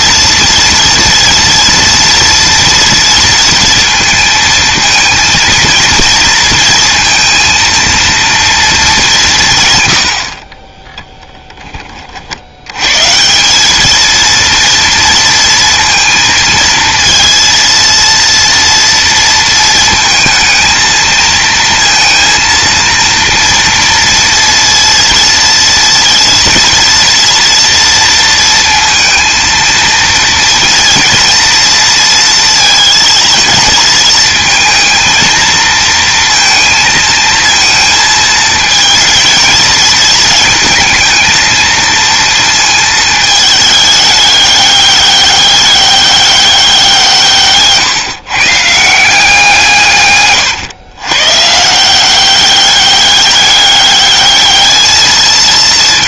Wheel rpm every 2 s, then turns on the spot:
230, 230, 230, 230, 180, 10, 160, 230, 230, 230, 220, 230, 230, 230, 230, 230, 230, 230, 230, 220, 220, 220, 200, 160, 170, 120, 200, 220.
none